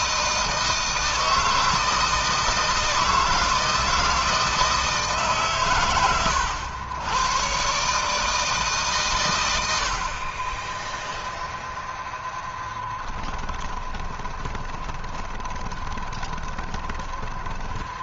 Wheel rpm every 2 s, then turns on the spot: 160, 160, 160, 100, 140, 10, 10, 20, 20.
12-18